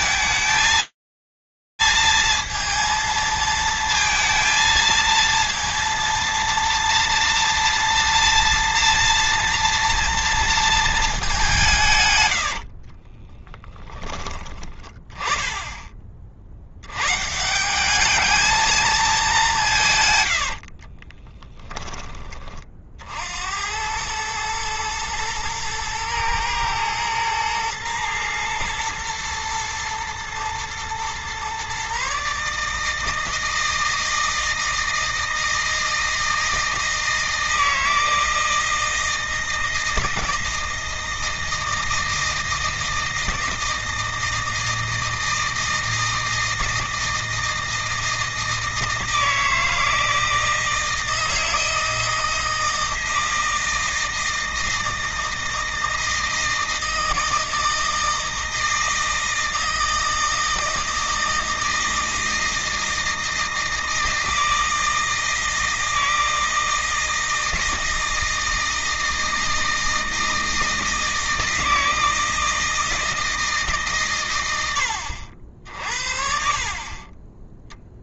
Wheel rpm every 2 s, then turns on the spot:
230, 230, 230, 230, 230, 180, 30, 20, 120, 210, 30, 60, 110, 110, 110, 120, 160, 160, 160, 160, 160, 160, 160, 160, 160, 160, 160, 160, 160, 160, 160, 160, 160, 160, 160, 160, 160, 100, 40.
12-14 20-22